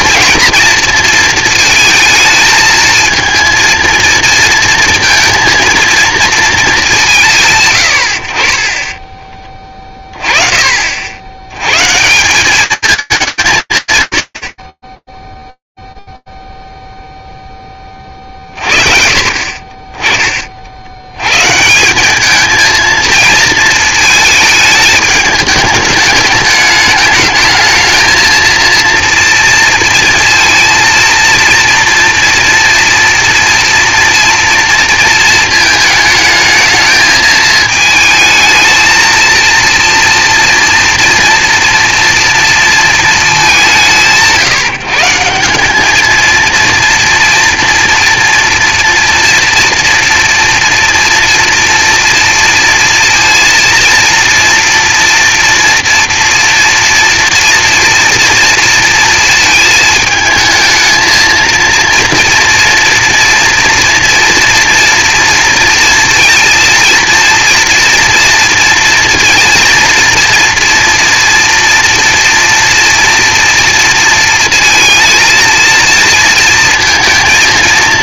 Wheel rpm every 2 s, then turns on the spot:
230, 220, 230, 200, 30, 40, 200, 100, 0, 40, 50, 220, 220, 210, 230, 230, 230, 230, 220, 220, 230, 230, 160, 230, 240, 240, 230, 230, 240, 230, 220, 230, 230, 230, 230, 230, 230, 230, 230.
none